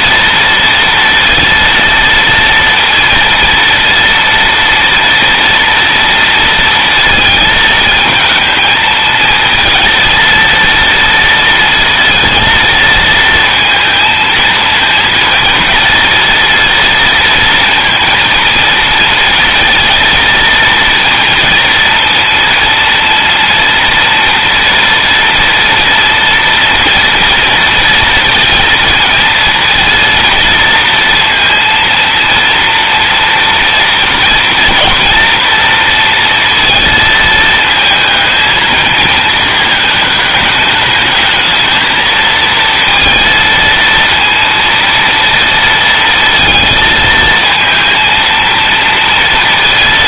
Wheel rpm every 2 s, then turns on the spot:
230, 230, 230, 230, 220, 230, 230, 230, 230, 220, 230, 230, 230, 240, 230, 230, 230, 230, 220, 230, 220, 230, 230, 230, 230.
none